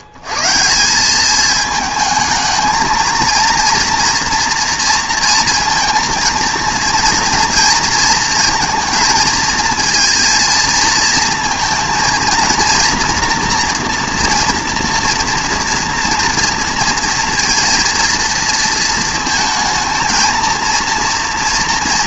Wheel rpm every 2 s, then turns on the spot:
130, 220, 230, 230, 230, 220, 230, 230, 230, 220, 230.
none